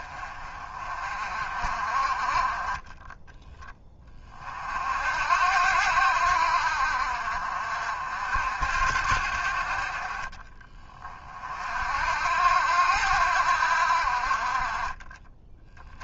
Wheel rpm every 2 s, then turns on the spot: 40, 20, 60, 60, 60, 40, 80, 30.
none